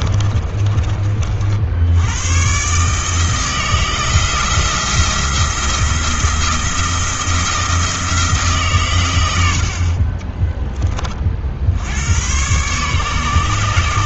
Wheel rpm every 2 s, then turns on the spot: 30, 130, 170, 170, 140, 20, 130.
0-2